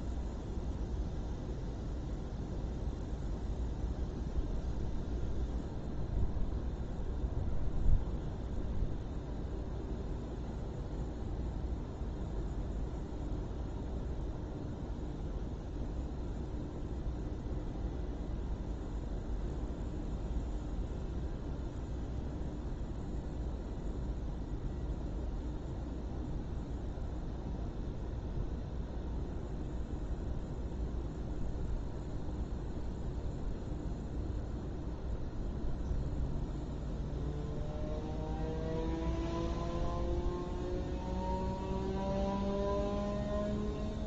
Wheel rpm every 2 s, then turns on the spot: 0, 0, 0, 0, 0, 0, 0, 0, 0, 0, 0, 0, 0, 0, 0, 0, 0, 0, 0, 0, 0, 0.
none